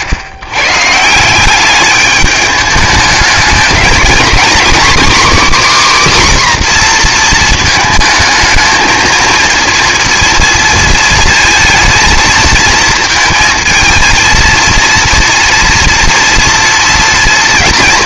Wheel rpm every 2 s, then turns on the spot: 100, 210, 260, 260, 220, 230, 220, 230, 230.
none